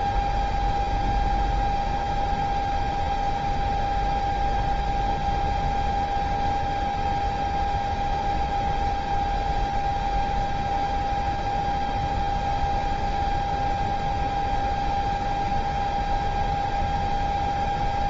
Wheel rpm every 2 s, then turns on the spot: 0, 0, 0, 0, 0, 0, 0, 0, 0.
none